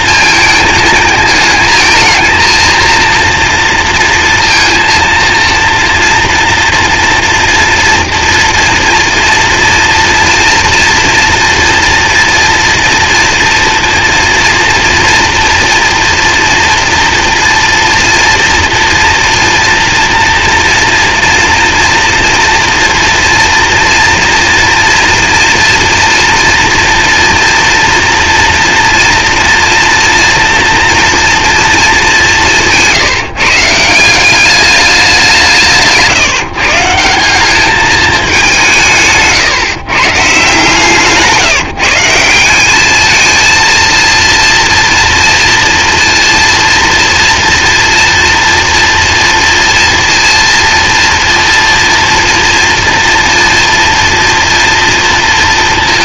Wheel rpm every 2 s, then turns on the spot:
220, 230, 230, 240, 240, 230, 230, 230, 230, 230, 230, 240, 230, 230, 230, 230, 160, 200, 160, 190, 150, 190, 230, 230, 230, 230, 230, 230.
none